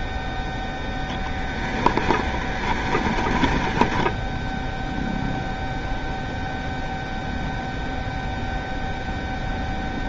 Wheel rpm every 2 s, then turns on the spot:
0, 20, 0, 0, 0.
2-4